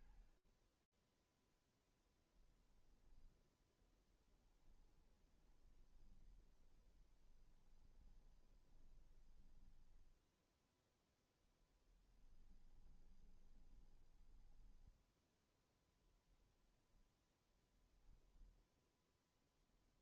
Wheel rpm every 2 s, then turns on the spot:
0, 20, 20, 20, 10, 10, 20, 0, 0, 0.
2-14